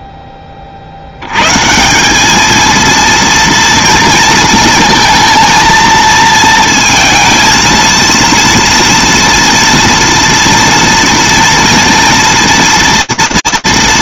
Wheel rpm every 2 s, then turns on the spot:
40, 230, 230, 230, 230, 230, 230.
none